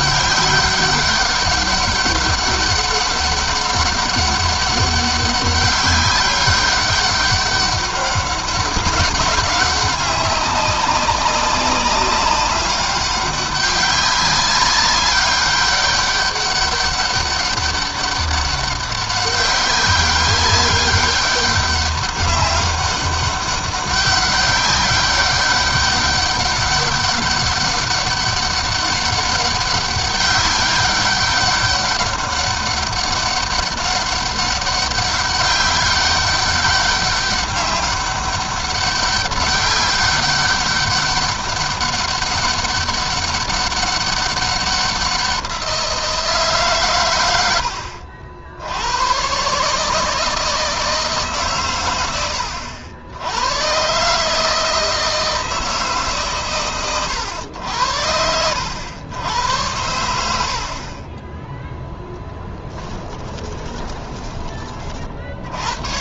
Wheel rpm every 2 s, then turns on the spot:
200, 200, 200, 200, 200, 190, 200, 200, 200, 200, 200, 200, 200, 200, 200, 200, 200, 200, 200, 200, 200, 200, 190, 110, 110, 150, 90, 160, 120, 90, 20, 10, 50.
62-64